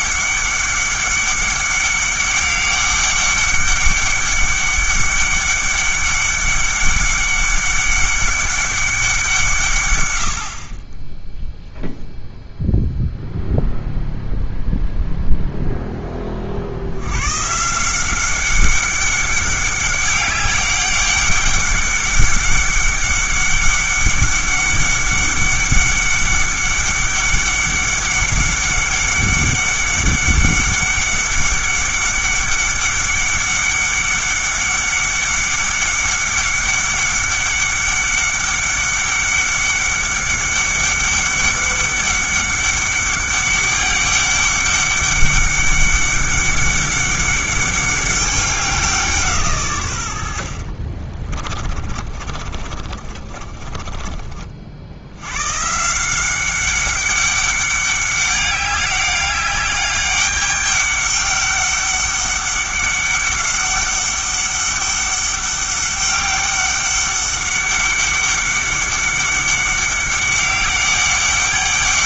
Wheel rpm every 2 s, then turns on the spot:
200, 200, 200, 200, 200, 40, 0, 0, 80, 190, 200, 200, 200, 200, 200, 200, 200, 200, 200, 200, 200, 200, 200, 200, 180, 50, 30, 60, 190, 190, 200, 200, 200, 200, 200, 200.
50-54